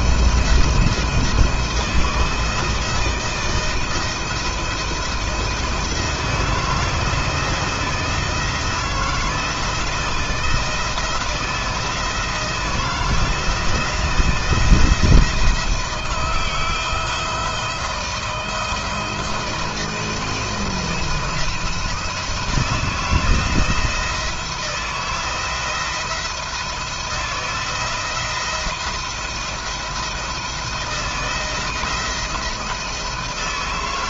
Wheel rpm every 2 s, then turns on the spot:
170, 160, 170, 160, 160, 170, 170, 170, 170, 160, 170, 170, 160, 170, 170, 170, 170.
none